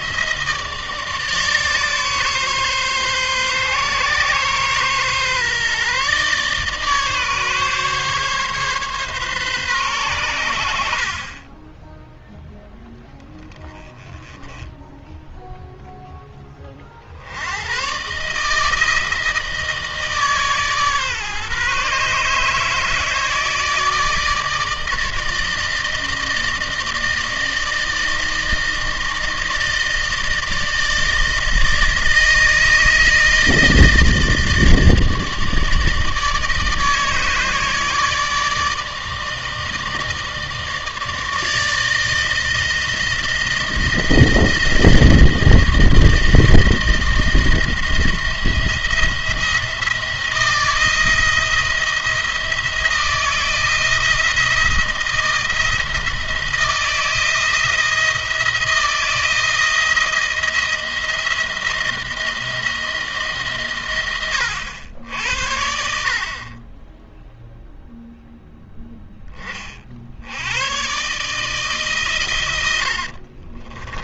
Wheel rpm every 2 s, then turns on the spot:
150, 140, 130, 140, 140, 90, 0, 10, 30, 150, 150, 150, 160, 160, 160, 160, 160, 160, 150, 150, 160, 160, 160, 160, 170, 170, 170, 170, 160, 170, 170, 160, 80, 30, 0, 100, 100.
72-74